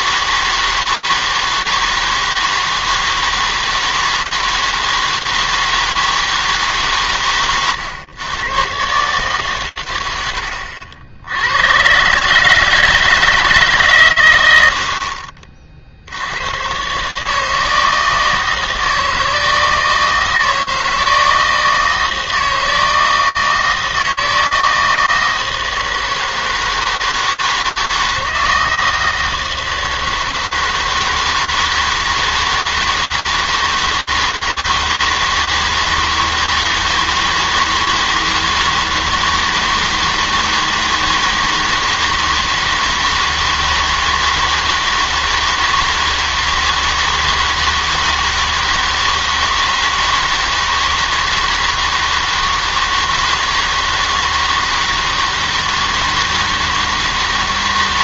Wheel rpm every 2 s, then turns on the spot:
160, 160, 160, 150, 120, 80, 150, 80, 120, 160, 160, 160, 160, 160, 160, 160, 160, 160, 160, 160, 160, 160, 160, 160, 160, 160, 160, 160, 160.
none